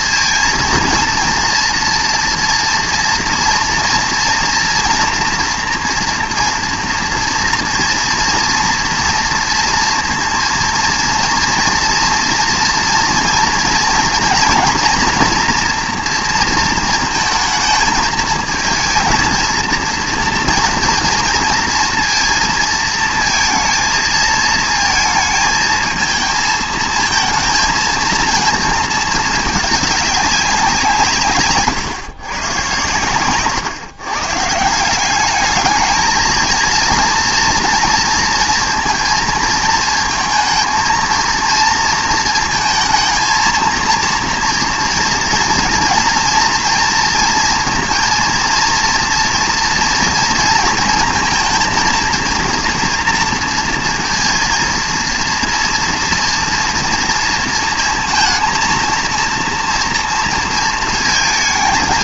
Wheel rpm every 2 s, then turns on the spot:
230, 230, 230, 230, 230, 230, 230, 230, 230, 230, 230, 230, 220, 220, 220, 170, 120, 170, 230, 230, 230, 230, 230, 230, 230, 230, 240, 230, 230, 230, 230.
none